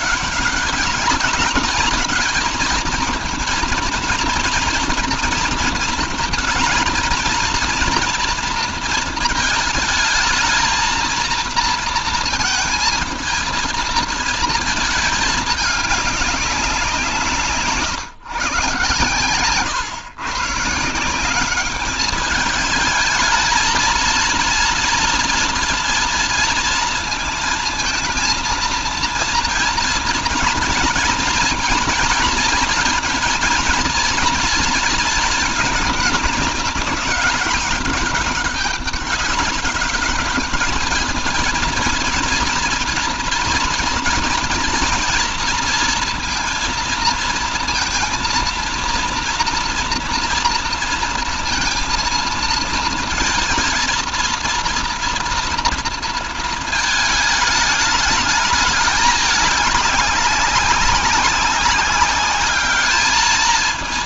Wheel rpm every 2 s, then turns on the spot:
200, 230, 240, 230, 220, 230, 220, 210, 170, 130, 180, 220, 240, 230, 230, 230, 230, 220, 200, 200, 220, 230, 230, 220, 230, 230, 230, 240, 220, 210, 190, 210.
none